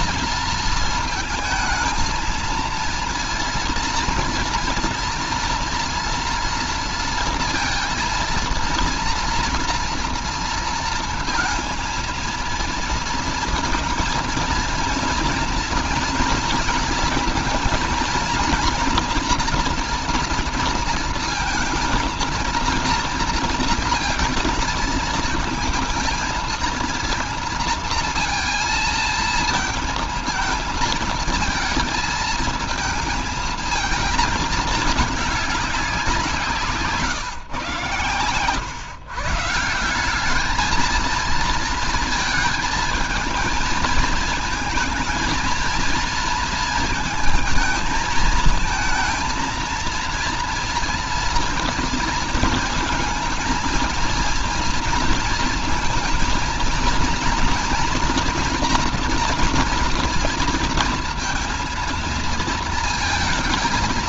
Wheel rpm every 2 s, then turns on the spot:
230, 230, 230, 230, 230, 230, 230, 230, 230, 240, 230, 230, 230, 230, 230, 220, 230, 220, 180, 120, 210, 220, 220, 230, 220, 230, 230, 230, 230, 230, 230, 230.
none